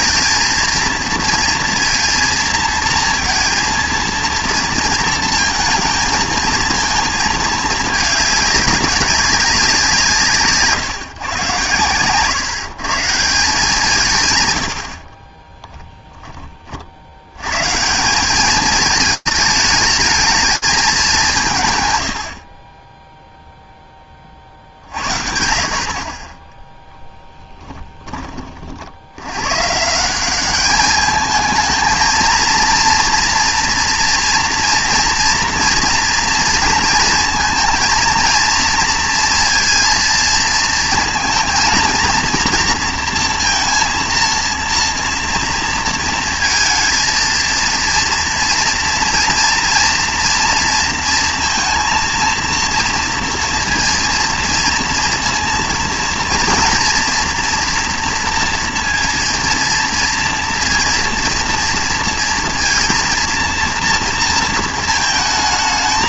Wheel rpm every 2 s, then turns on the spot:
230, 230, 230, 230, 210, 150, 150, 110, 40, 210, 200, 20, 50, 10, 30, 200, 230, 230, 230, 230, 230, 230, 230, 220, 230, 230, 230, 230, 230, 230, 230, 230, 230.
none